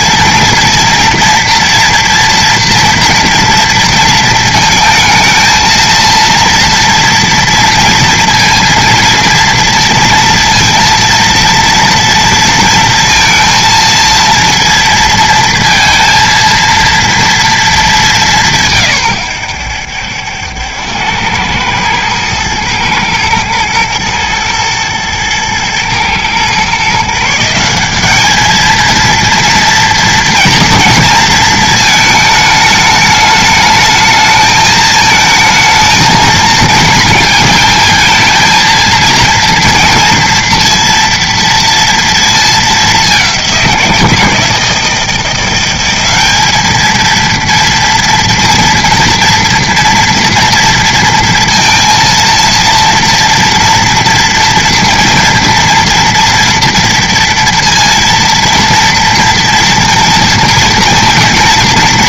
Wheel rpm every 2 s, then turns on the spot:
230, 240, 230, 230, 230, 230, 230, 230, 230, 180, 90, 110, 120, 120, 220, 230, 220, 220, 220, 230, 230, 220, 160, 210, 230, 230, 230, 230, 230, 240, 230.
none